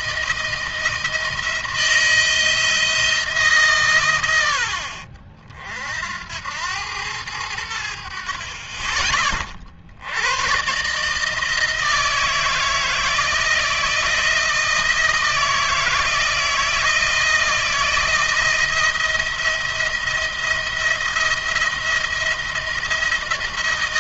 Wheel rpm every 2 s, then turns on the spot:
160, 160, 60, 100, 30, 140, 160, 170, 160, 170, 170, 170.
none